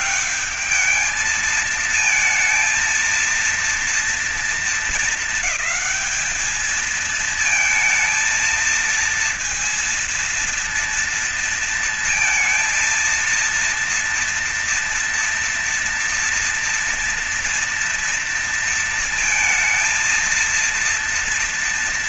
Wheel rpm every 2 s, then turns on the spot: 210, 230, 230, 220, 230, 230, 230, 230, 230, 230, 230.
none